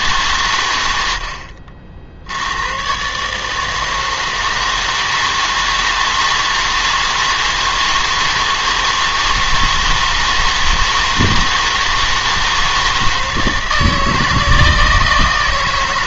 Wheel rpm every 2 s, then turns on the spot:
110, 100, 160, 160, 160, 160, 160, 160.
none